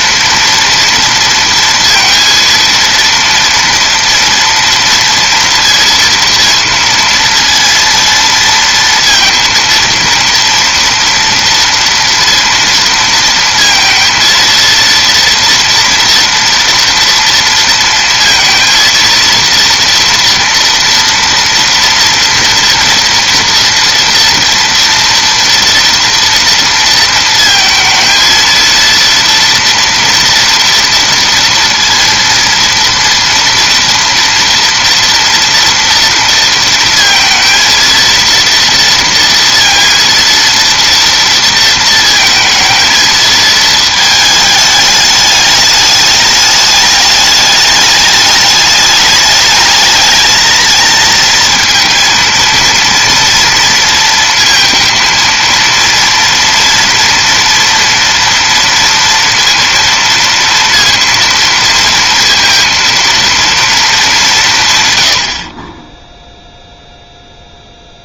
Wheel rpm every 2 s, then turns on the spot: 230, 230, 230, 230, 230, 230, 230, 230, 230, 230, 230, 230, 230, 230, 230, 230, 230, 230, 230, 230, 230, 230, 210, 210, 210, 220, 230, 230, 230, 230, 230, 230, 140, 0.
none